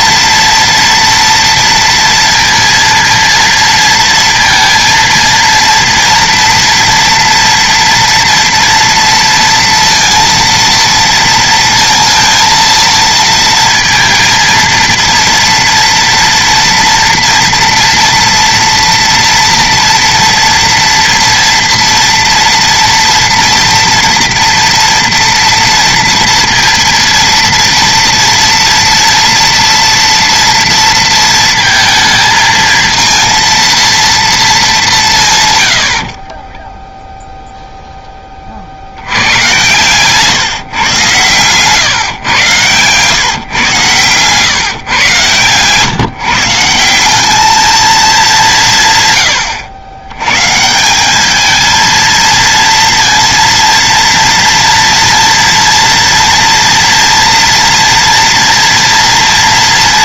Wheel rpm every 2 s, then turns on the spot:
230, 230, 230, 230, 230, 230, 230, 230, 230, 230, 230, 230, 230, 230, 230, 230, 230, 220, 20, 70, 140, 120, 120, 170, 150, 160, 230, 230, 230, 230.
36-38